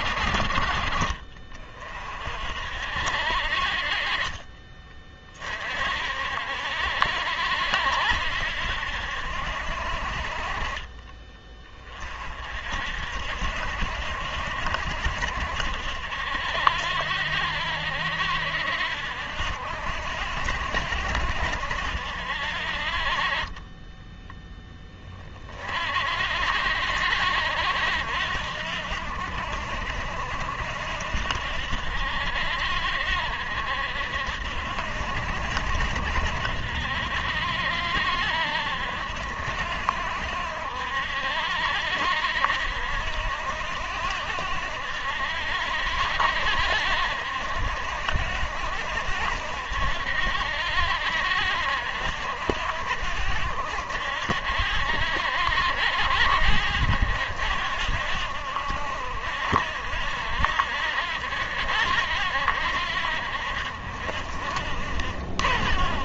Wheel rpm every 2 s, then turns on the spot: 50, 50, 20, 70, 70, 30, 60, 60, 60, 60, 70, 50, 20, 70, 70, 60, 60, 70, 60, 70, 70, 60, 70, 60, 60, 60, 60, 60, 70, 70, 60, 70, 50.
none